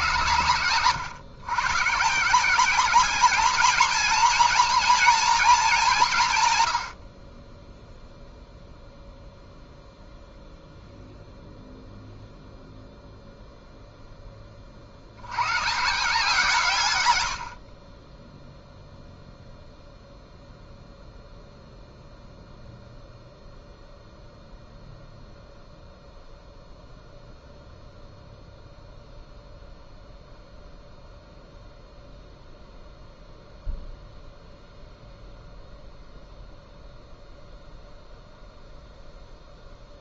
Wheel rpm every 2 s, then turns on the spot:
100, 180, 230, 120, 0, 0, 0, 30, 150, 0, 0, 0, 0, 0, 0, 0, 0, 0, 0, 0.
none